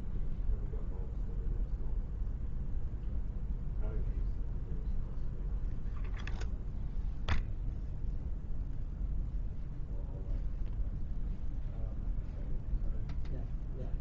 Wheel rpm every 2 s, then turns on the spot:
0, 0, 0, 0, 0, 0, 0.
none